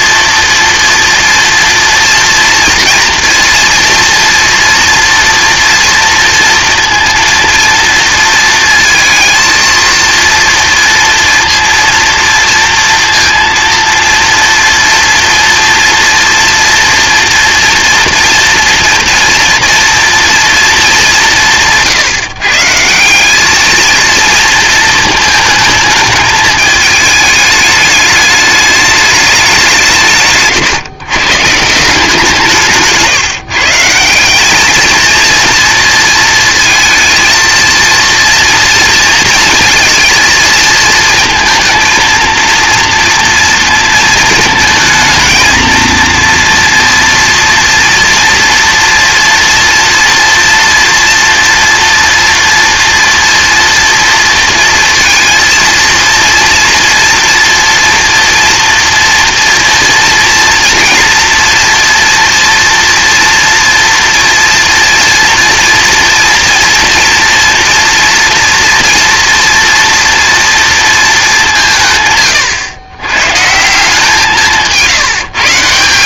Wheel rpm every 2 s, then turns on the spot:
230, 230, 230, 230, 230, 230, 230, 230, 230, 230, 220, 150, 220, 210, 210, 140, 170, 210, 220, 240, 230, 230, 220, 230, 230, 240, 230, 230, 230, 230, 230, 230, 240, 230, 230, 230, 120, 180.
32-34